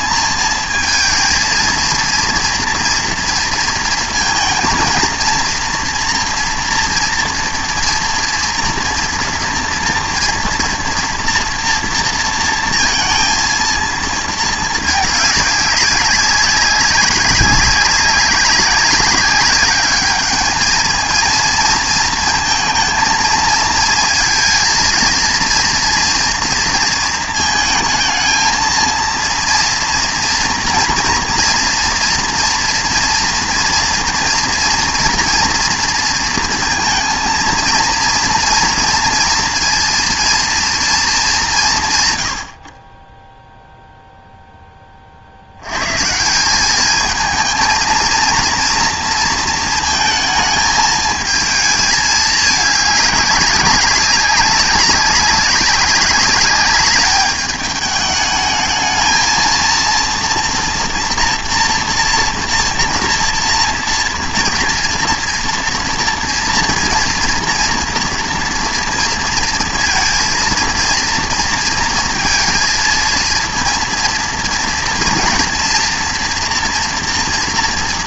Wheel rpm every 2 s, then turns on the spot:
220, 230, 230, 240, 230, 240, 230, 220, 190, 190, 210, 230, 230, 230, 230, 240, 230, 230, 230, 230, 230, 50, 10, 190, 230, 220, 210, 190, 200, 220, 230, 230, 240, 240, 240, 230, 230, 230, 240.
none